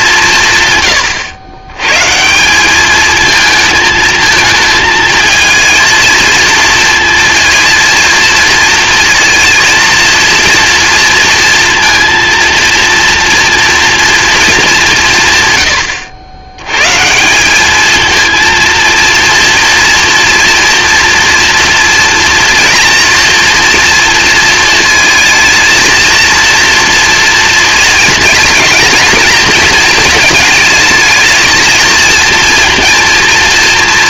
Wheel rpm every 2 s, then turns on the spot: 150, 200, 220, 230, 230, 230, 230, 220, 110, 230, 230, 230, 230, 230, 220, 220, 230.
none